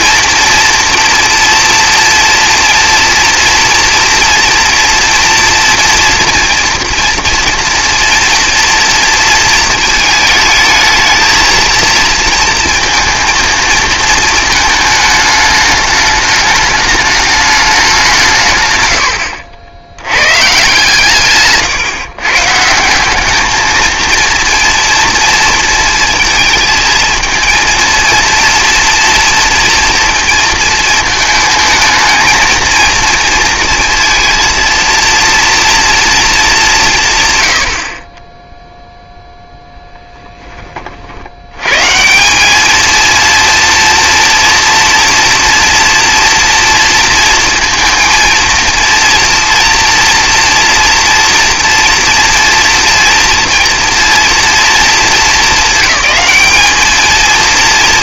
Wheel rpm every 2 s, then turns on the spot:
230, 230, 240, 230, 230, 220, 230, 220, 210, 110, 140, 160, 230, 220, 230, 230, 230, 230, 190, 0, 30, 220, 240, 230, 230, 240, 230, 230, 220.
none